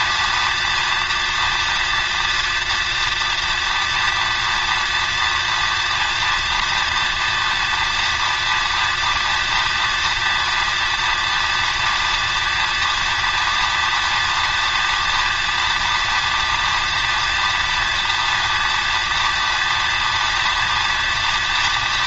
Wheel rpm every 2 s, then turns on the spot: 230, 230, 230, 230, 240, 230, 230, 230, 230, 230, 230.
none